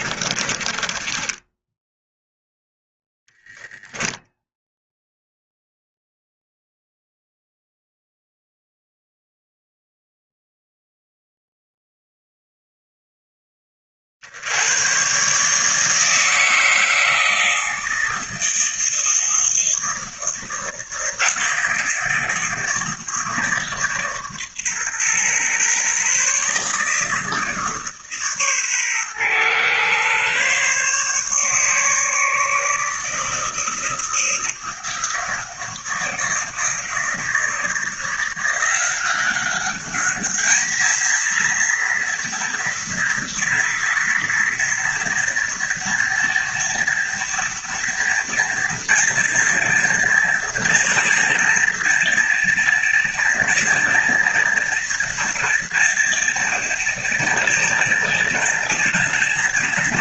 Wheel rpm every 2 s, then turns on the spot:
20, 0, 0, 0, 0, 0, 0, 120, 160, 160, 160, 160, 130, 150, 130, 140, 150, 160, 160, 180, 220, 230, 230, 230, 230, 230, 230, 230, 230, 230.
0-2